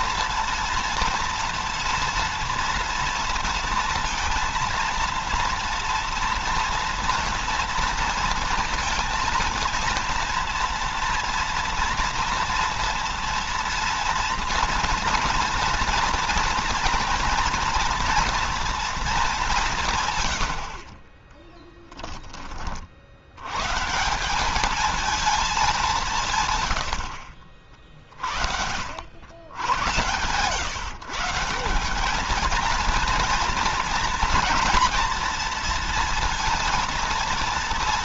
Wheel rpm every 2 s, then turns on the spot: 230, 230, 230, 230, 230, 230, 240, 230, 230, 230, 70, 50, 200, 110, 80, 140, 220, 230, 230.
20-22